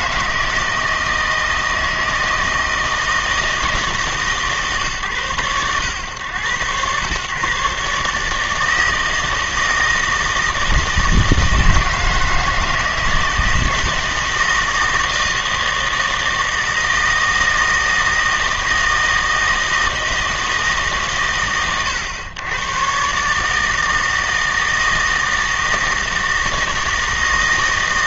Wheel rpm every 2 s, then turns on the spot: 160, 160, 140, 110, 160, 160, 160, 160, 160, 160, 160, 110, 160, 160.
none